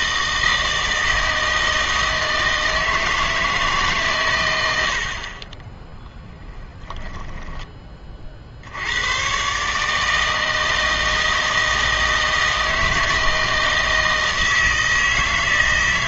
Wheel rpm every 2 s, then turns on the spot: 160, 160, 110, 10, 70, 160, 160, 160.
6-8